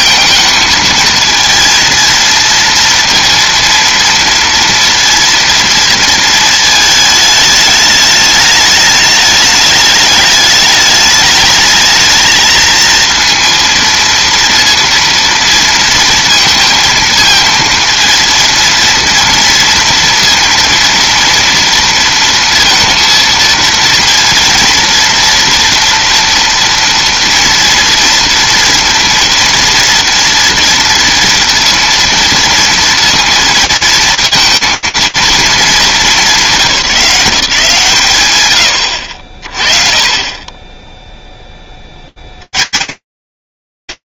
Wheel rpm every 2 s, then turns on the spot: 230, 230, 230, 220, 210, 210, 230, 230, 230, 230, 230, 230, 230, 230, 230, 230, 230, 230, 180, 90, 10, 120.
none